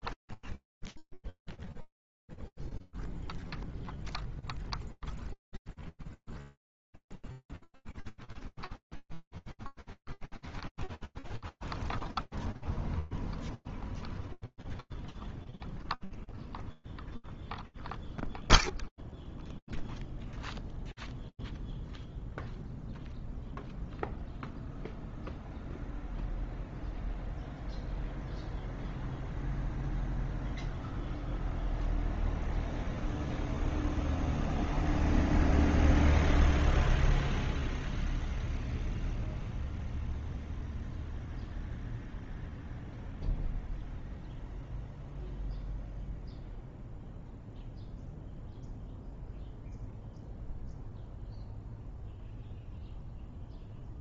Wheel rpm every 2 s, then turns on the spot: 0, 0, 0, 0, 0, 0, 0, 0, 0, 0, 0, 0, 0, 0, 0, 0, 0, 0, 0, 0, 0, 0, 0, 0, 0, 0, 0.
none